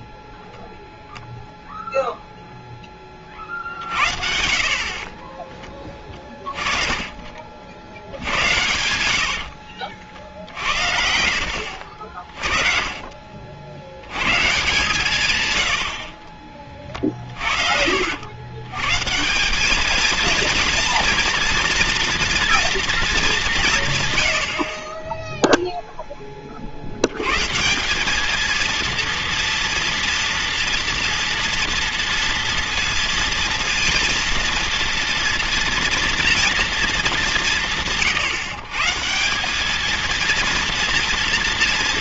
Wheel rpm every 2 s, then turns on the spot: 0, 0, 50, 20, 90, 60, 40, 140, 30, 110, 230, 230, 50, 40, 220, 230, 230, 230, 230, 150, 230.
8-10 12-14